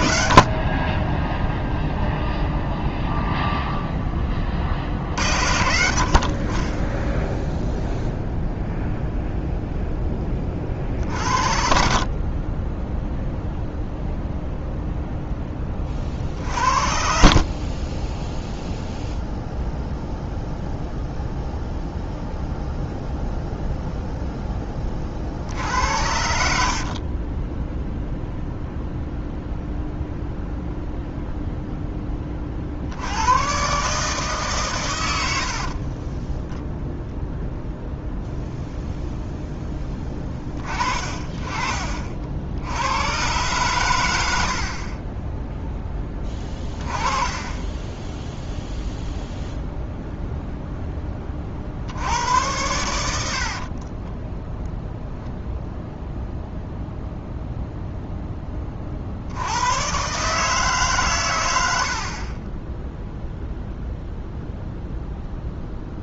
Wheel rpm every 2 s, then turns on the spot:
30, 0, 50, 30, 0, 50, 20, 0, 50, 0, 0, 0, 30, 50, 0, 0, 70, 120, 0, 0, 40, 90, 40, 20, 0, 10, 90, 0, 0, 30, 150, 0, 0.
16-18 44-48